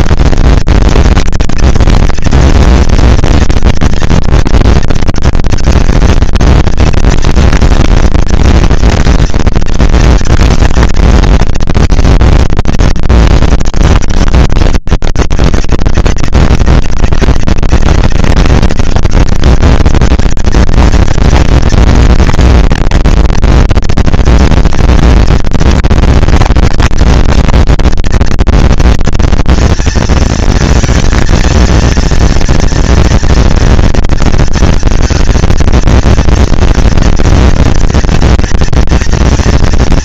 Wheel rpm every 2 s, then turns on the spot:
230, 230, 230, 230, 230, 230, 230, 210, 190, 200, 220, 230, 230, 230, 230, 230, 230, 230, 230, 230.
none